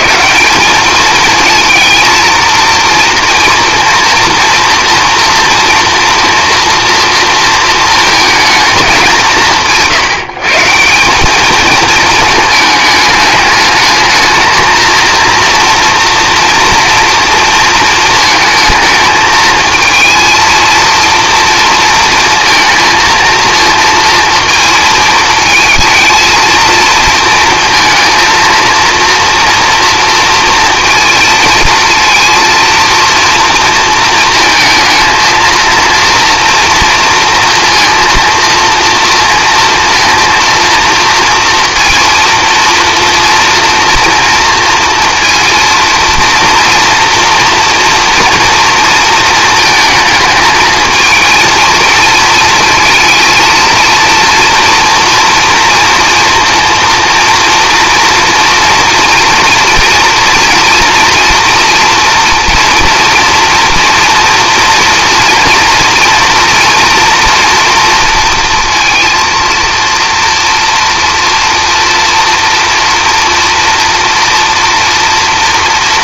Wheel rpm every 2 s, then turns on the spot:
210, 230, 230, 230, 210, 170, 220, 220, 240, 220, 230, 230, 220, 230, 230, 230, 230, 220, 230, 230, 230, 230, 230, 230, 230, 220, 230, 230, 230, 230, 230, 230, 230, 230, 230, 230, 230, 230.
none